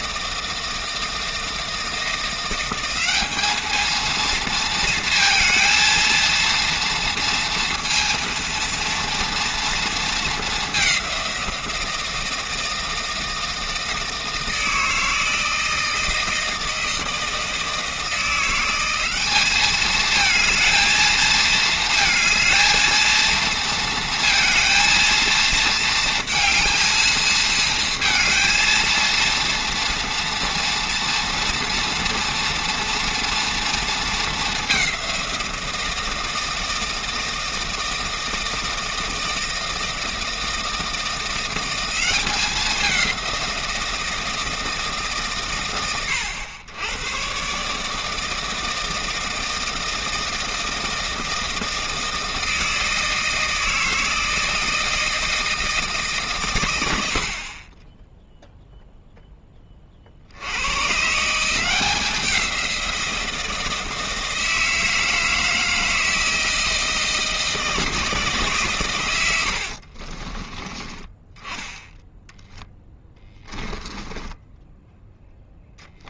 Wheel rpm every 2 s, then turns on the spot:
160, 190, 220, 230, 230, 190, 160, 160, 160, 190, 220, 220, 230, 220, 230, 230, 230, 190, 160, 160, 160, 190, 120, 100, 160, 160, 160, 160, 100, 0, 110, 180, 160, 160, 120, 20, 10, 10.
56-58 72-74